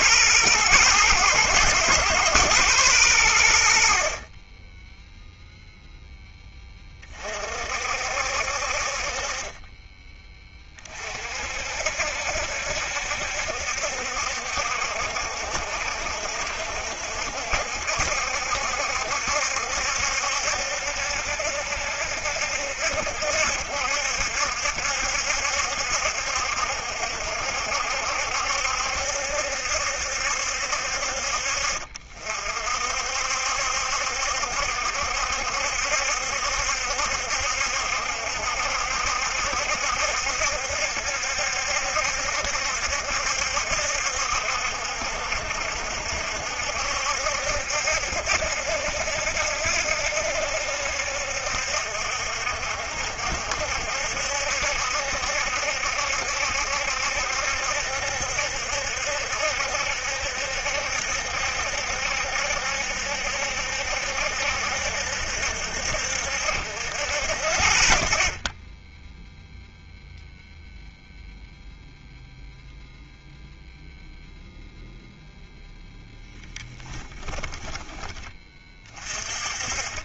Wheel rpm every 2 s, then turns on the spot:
110, 110, 10, 20, 50, 30, 70, 60, 60, 70, 70, 70, 70, 70, 70, 60, 50, 70, 70, 70, 70, 70, 70, 70, 70, 70, 70, 70, 70, 70, 70, 70, 70, 50, 0, 0, 0, 0, 10, 30.
76-78